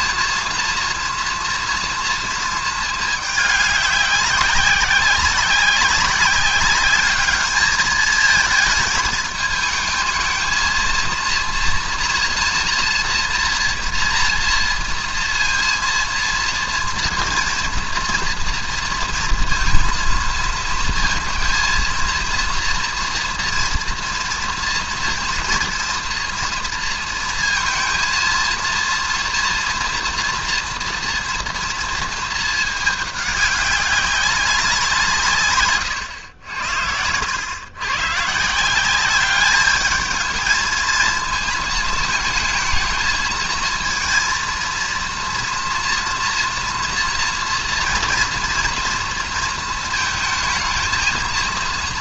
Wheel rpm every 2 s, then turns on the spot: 230, 220, 190, 200, 220, 230, 230, 230, 230, 230, 220, 230, 230, 230, 230, 230, 220, 180, 90, 170, 220, 210, 230, 240, 230, 220.
none